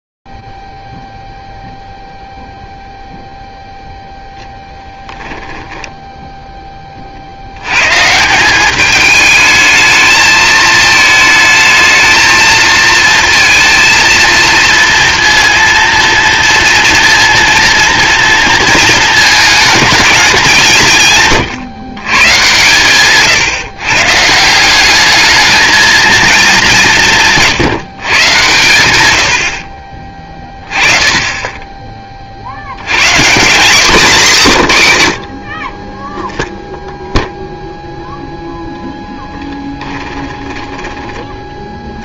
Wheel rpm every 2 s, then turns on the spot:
0, 0, 0, 10, 180, 220, 220, 230, 230, 230, 190, 140, 170, 200, 120, 20, 100, 120, 0, 0, 20.
none